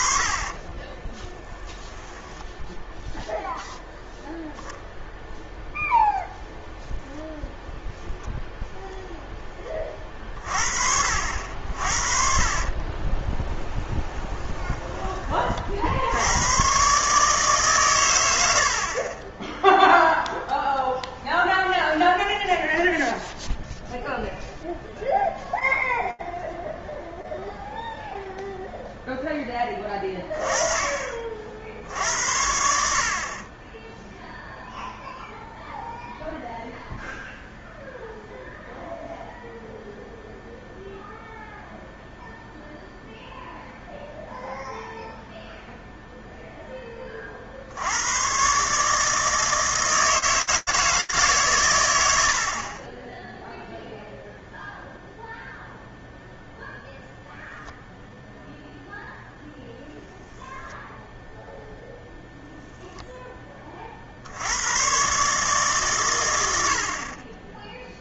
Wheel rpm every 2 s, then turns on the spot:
30, 10, 0, 0, 20, 50, 10, 40, 130, 10, 0, 0, 0, 0, 10, 50, 30, 0, 0, 0, 0, 0, 0, 30, 150, 140, 10, 0, 0, 0, 0, 40, 130, 10.
0-2 12-14 18-20